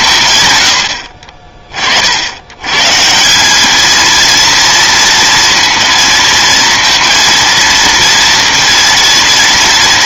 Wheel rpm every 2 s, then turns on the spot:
50, 220, 230, 230, 230.
none